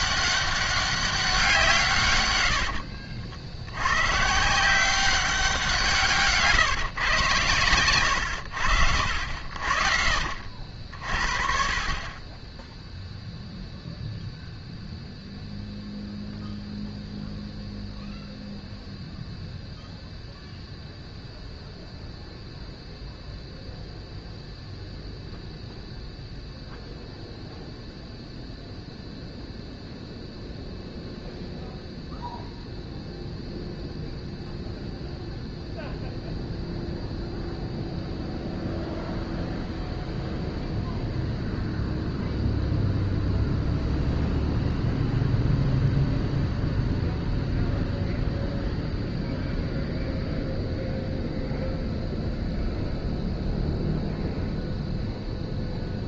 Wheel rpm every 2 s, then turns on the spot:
200, 70, 180, 130, 70, 50, 0, 0, 0, 0, 0, 0, 0, 0, 0, 0, 0, 0, 0, 0, 0, 0, 0, 0, 0, 0, 0, 0.
2-4